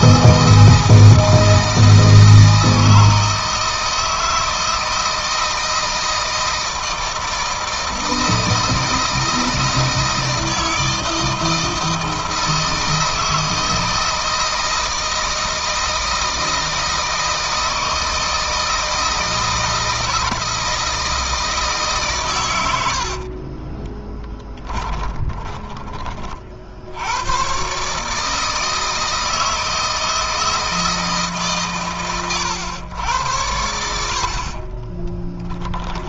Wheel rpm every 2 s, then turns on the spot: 160, 160, 160, 160, 160, 160, 160, 160, 160, 160, 160, 100, 20, 60, 160, 160, 100, 40.
22-26 34-36